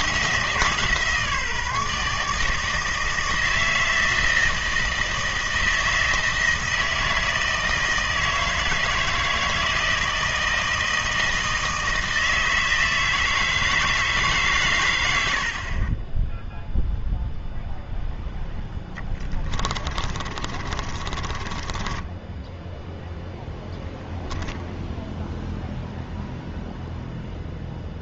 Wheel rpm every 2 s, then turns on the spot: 160, 160, 160, 160, 160, 160, 160, 120, 0, 10, 40, 0, 0, 0.
18-22